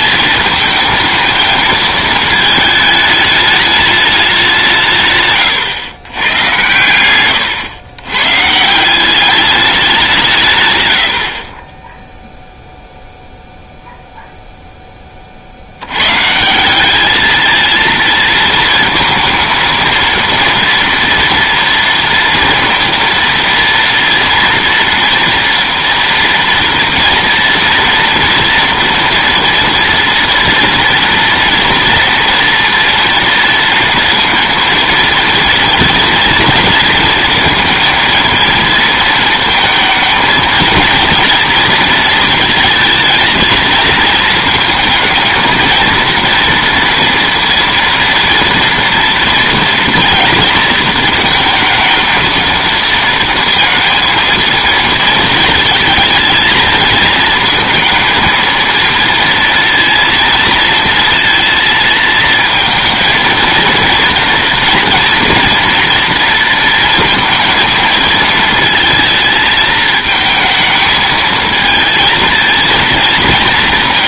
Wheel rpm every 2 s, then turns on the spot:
220, 220, 160, 120, 160, 120, 0, 10, 190, 230, 230, 230, 230, 230, 230, 230, 230, 230, 230, 230, 230, 220, 220, 230, 230, 230, 230, 220, 220, 230, 220, 230, 230, 230, 230, 220, 230.
none